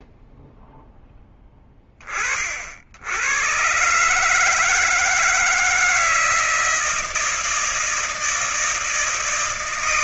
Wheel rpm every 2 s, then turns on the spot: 20, 40, 140, 160, 160.
none